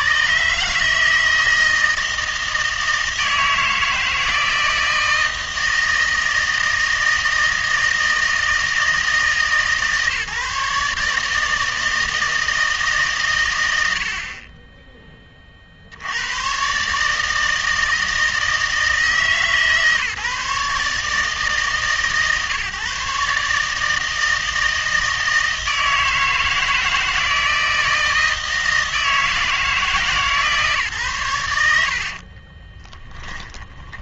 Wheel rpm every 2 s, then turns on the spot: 150, 160, 160, 160, 160, 150, 160, 20, 120, 160, 150, 140, 160, 160, 160, 150, 30.
32-34